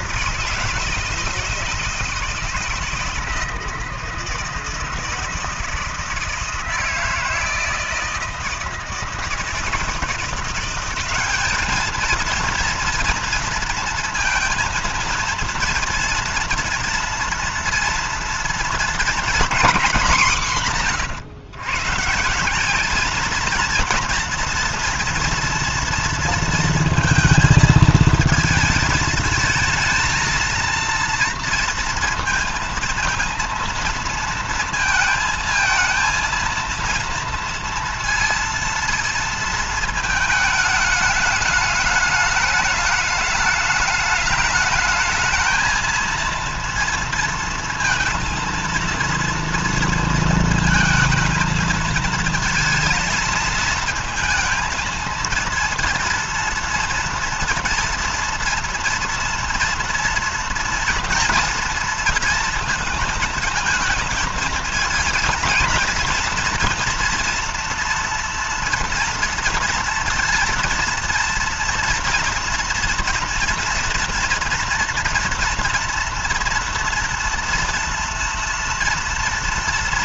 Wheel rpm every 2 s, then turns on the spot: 160, 160, 160, 160, 160, 180, 230, 230, 230, 230, 200, 170, 230, 230, 220, 230, 230, 230, 230, 230, 220, 210, 210, 230, 230, 230, 220, 220, 230, 230, 240, 230, 230, 230, 230, 230, 230, 230, 230, 230.
none